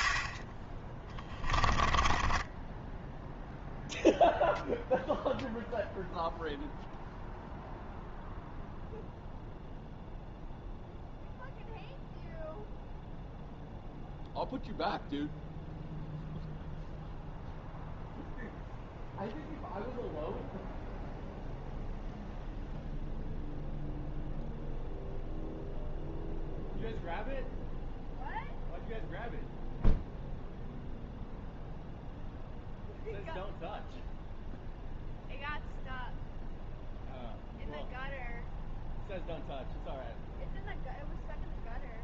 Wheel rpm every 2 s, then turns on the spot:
10, 10, 0, 0, 0, 0, 0, 0, 0, 0, 0, 0, 0, 0, 0, 0, 0, 0, 0, 0, 0.
0-4